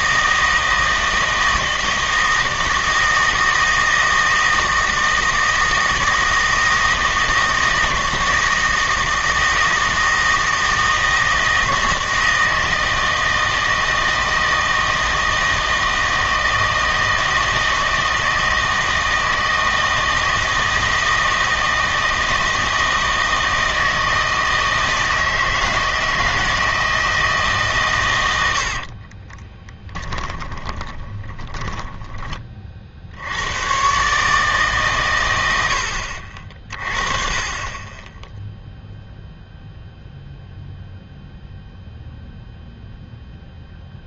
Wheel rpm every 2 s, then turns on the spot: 160, 160, 160, 160, 160, 160, 160, 160, 160, 160, 160, 160, 160, 160, 60, 20, 40, 140, 40, 0, 0, 0.
28-32